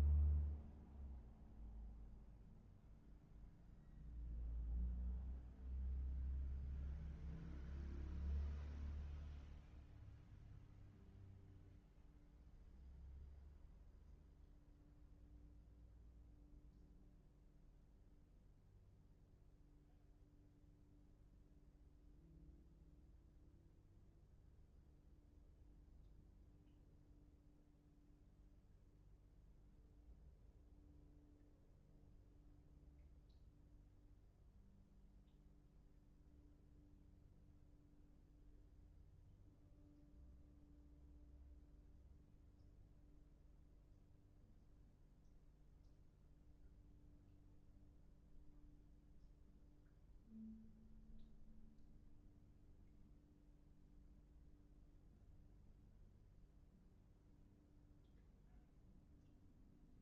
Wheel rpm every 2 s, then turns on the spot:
0, 0, 0, 0, 0, 0, 0, 0, 0, 0, 0, 0, 0, 0, 0, 0, 0, 0, 0, 0, 0, 0, 0, 0, 0, 0, 0, 0, 0, 0.
none